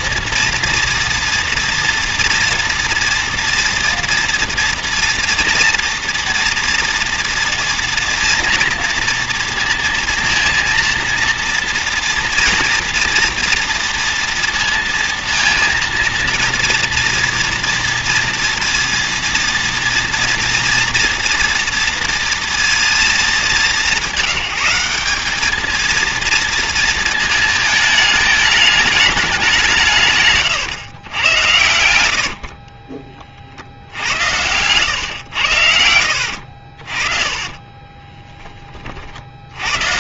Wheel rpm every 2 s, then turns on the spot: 230, 230, 230, 240, 240, 230, 230, 230, 230, 230, 230, 230, 190, 230, 210, 130, 30, 120, 60, 30.
32-34 36-38